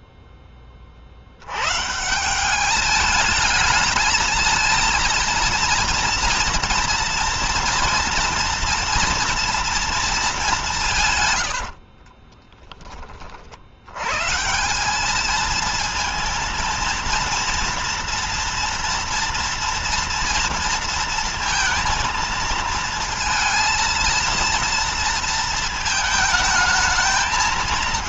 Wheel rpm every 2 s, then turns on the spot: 10, 180, 220, 240, 230, 200, 30, 150, 230, 230, 230, 230, 230, 220.
12-14